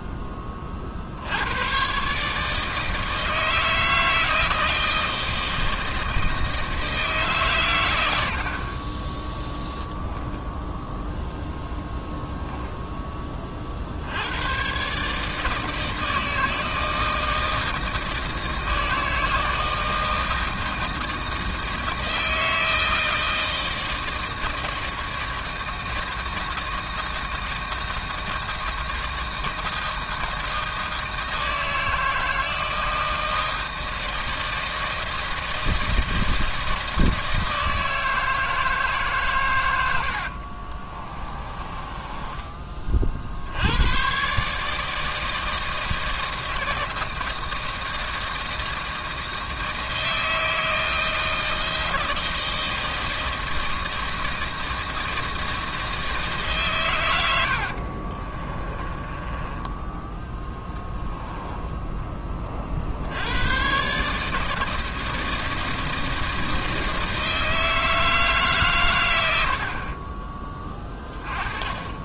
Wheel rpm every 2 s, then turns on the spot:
30, 160, 160, 160, 50, 0, 0, 110, 160, 160, 160, 160, 160, 160, 160, 160, 160, 160, 160, 160, 40, 30, 150, 160, 160, 160, 160, 160, 130, 20, 10, 40, 160, 160, 140, 20.
40-42 58-60